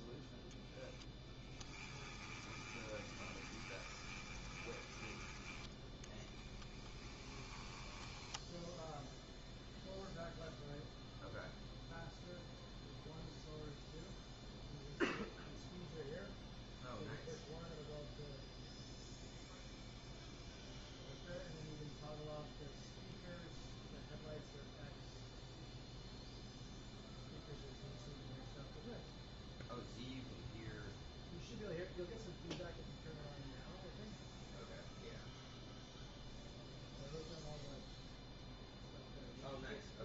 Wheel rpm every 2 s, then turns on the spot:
10, 20, 20, 10, 0, 0, 0, 0, 0, 0, 0, 0, 0, 0, 0, 0, 0, 0, 0, 0.
0-8